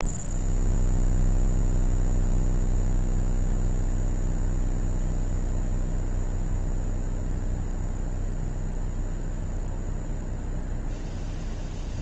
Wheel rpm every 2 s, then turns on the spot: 0, 0, 0, 0, 0, 0.
none